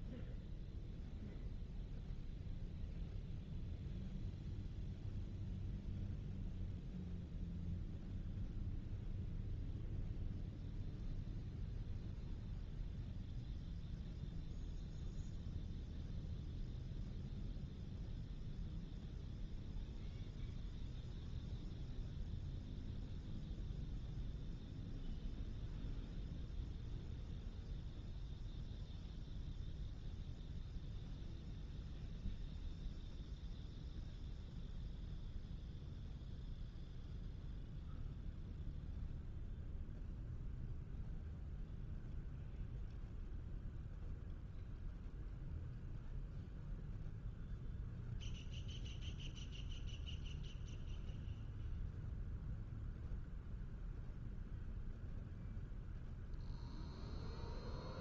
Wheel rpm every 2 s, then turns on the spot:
0, 0, 0, 0, 0, 0, 0, 0, 0, 0, 0, 0, 0, 0, 0, 0, 0, 0, 0, 0, 0, 0, 0, 0, 0, 0, 0, 0, 0.
none